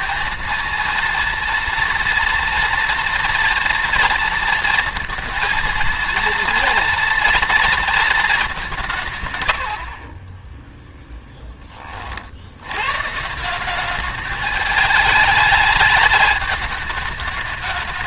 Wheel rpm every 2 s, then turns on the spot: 230, 230, 230, 230, 190, 10, 90, 210, 210.
none